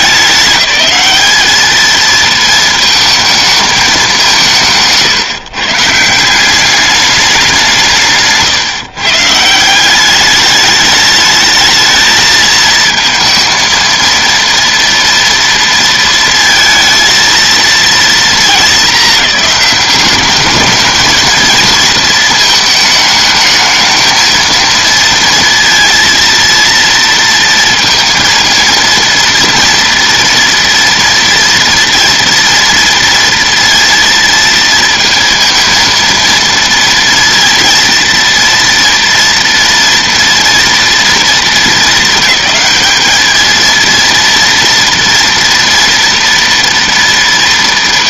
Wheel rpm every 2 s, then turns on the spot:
210, 220, 160, 200, 150, 210, 220, 230, 230, 210, 220, 220, 230, 230, 230, 230, 230, 230, 230, 230, 230, 210, 240, 230.
none